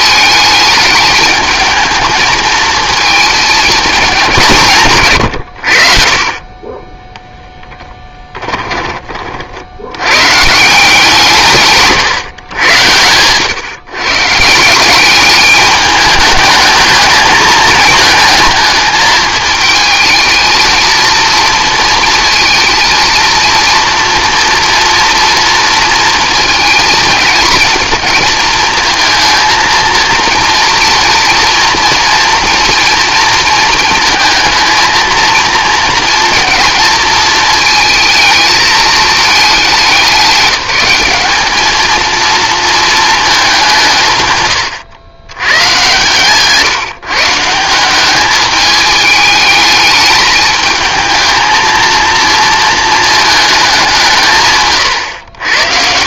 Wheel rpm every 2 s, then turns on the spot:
220, 220, 150, 10, 20, 160, 100, 180, 220, 220, 230, 230, 230, 220, 230, 230, 230, 230, 220, 220, 190, 230, 100, 140, 210, 220, 220, 120.
none